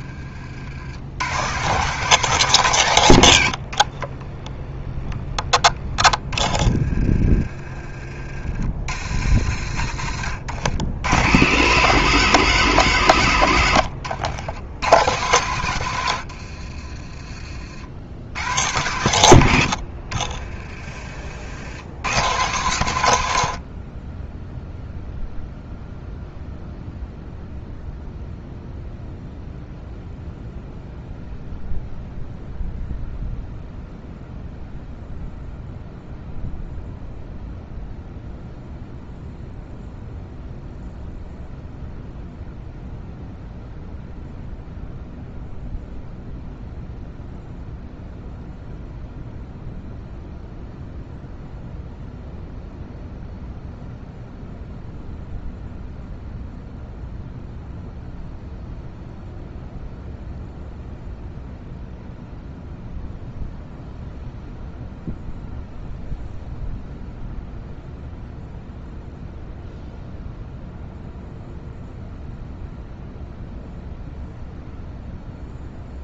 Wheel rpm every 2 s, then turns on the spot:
80, 130, 10, 20, 60, 90, 130, 110, 50, 100, 30, 110, 0, 0, 0, 0, 0, 0, 0, 0, 0, 0, 0, 0, 0, 0, 0, 0, 0, 0, 0, 0, 0, 0, 0, 0, 0, 0.
16-18 20-22